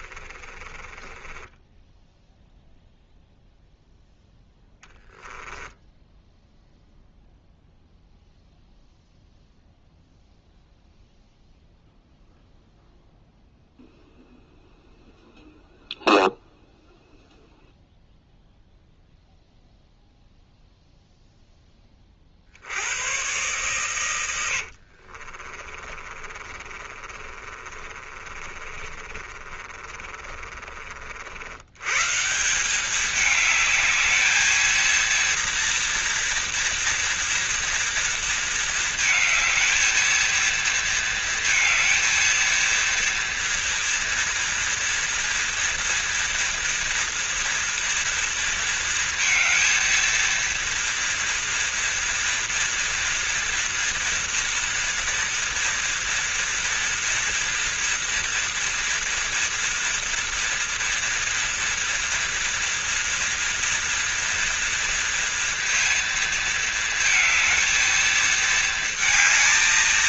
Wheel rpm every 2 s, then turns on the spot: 30, 0, 0, 0, 0, 0, 0, 0, 0, 0, 0, 90, 60, 30, 30, 50, 190, 230, 230, 220, 230, 230, 230, 230, 230, 230, 230, 230, 230, 230, 230, 230, 230, 220, 220.
0-2 24-30